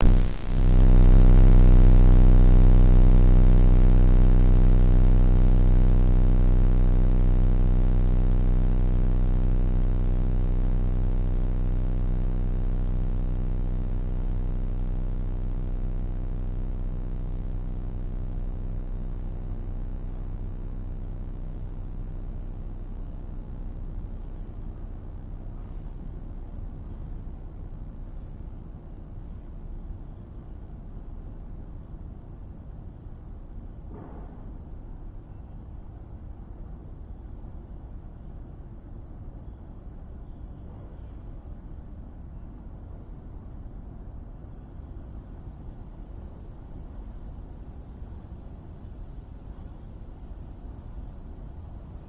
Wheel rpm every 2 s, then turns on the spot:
0, 0, 0, 0, 0, 0, 0, 0, 0, 0, 0, 0, 0, 0, 0, 0, 0, 0, 0, 0, 0, 0, 0, 0, 0, 0.
none